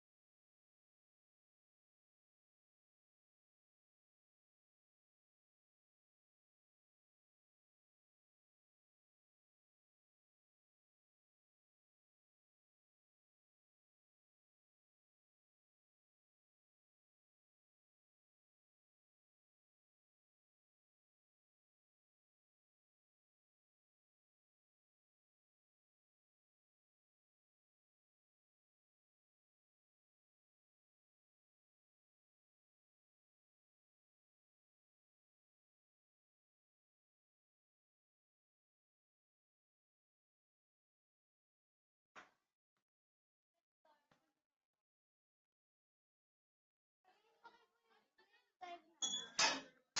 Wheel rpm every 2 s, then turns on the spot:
0, 0, 0, 0, 0, 0, 0, 0, 0, 0, 0, 0, 0, 0, 0, 0, 0, 0, 0, 0, 0, 0, 0, 0, 0.
none